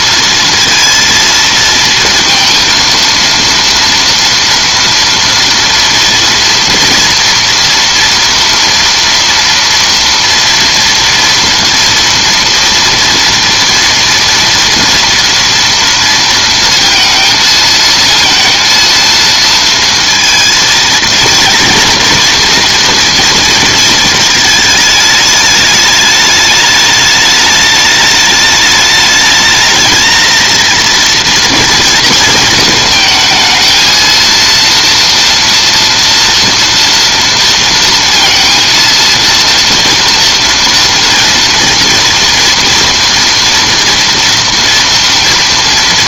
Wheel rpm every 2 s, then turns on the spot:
230, 230, 230, 230, 230, 230, 230, 230, 230, 230, 230, 230, 210, 210, 210, 230, 220, 230, 230, 230, 230, 230, 230.
none